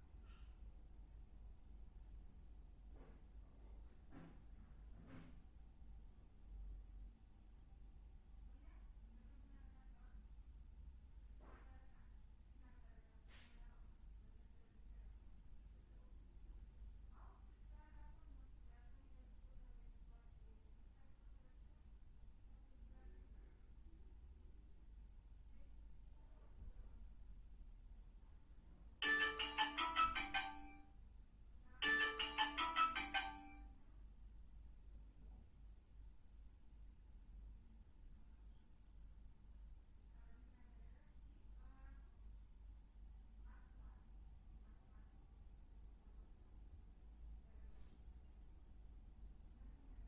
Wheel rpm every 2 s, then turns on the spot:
0, 0, 0, 0, 0, 0, 0, 0, 0, 0, 0, 0, 0, 0, 0, 0, 0, 0, 0, 0, 0, 0, 0, 0, 0.
none